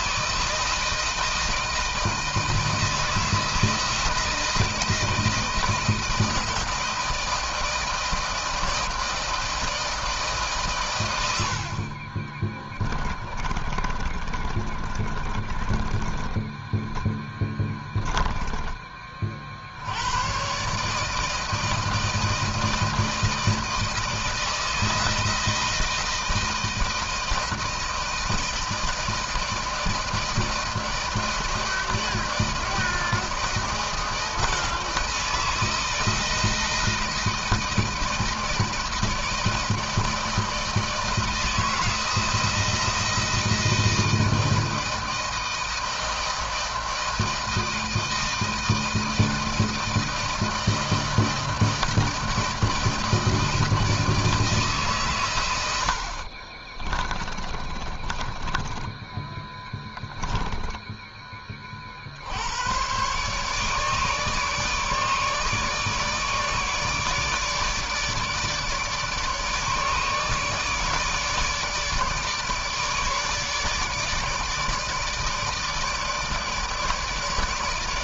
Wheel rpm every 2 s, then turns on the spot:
160, 160, 170, 160, 160, 150, 30, 30, 10, 10, 120, 160, 160, 160, 160, 160, 160, 160, 160, 160, 160, 170, 160, 160, 160, 160, 160, 160, 40, 20, 10, 80, 150, 150, 150, 150, 150, 150, 150.
12-18 56-62